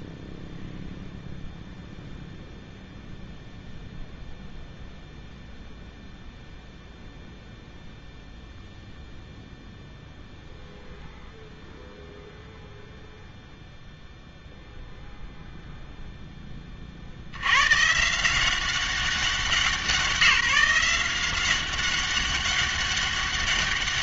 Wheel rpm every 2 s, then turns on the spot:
0, 0, 0, 0, 0, 0, 0, 0, 20, 190, 180, 200.
none